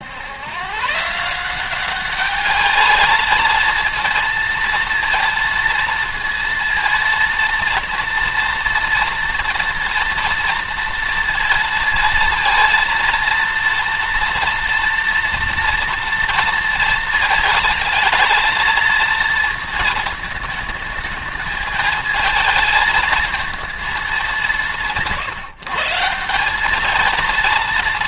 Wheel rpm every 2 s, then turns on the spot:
120, 210, 230, 230, 230, 230, 230, 230, 230, 220, 220, 220, 180, 180.
none